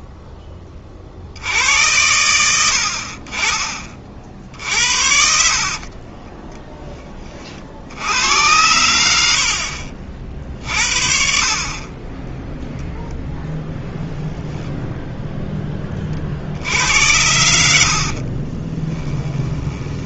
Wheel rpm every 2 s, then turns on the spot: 20, 100, 60, 10, 90, 40, 0, 0, 80, 30.
4-6 18-20